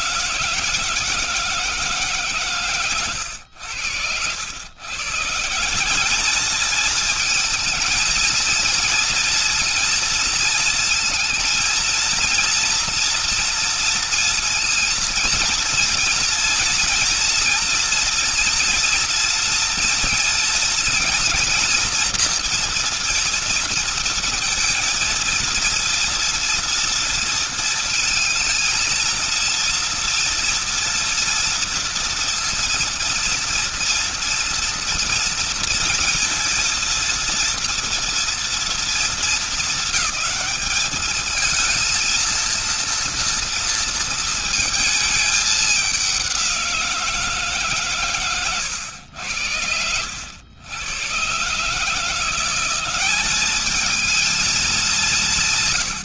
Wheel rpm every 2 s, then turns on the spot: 160, 140, 90, 200, 230, 230, 230, 230, 230, 240, 230, 230, 230, 230, 220, 230, 230, 230, 230, 230, 220, 230, 220, 190, 130, 90, 170, 210.
none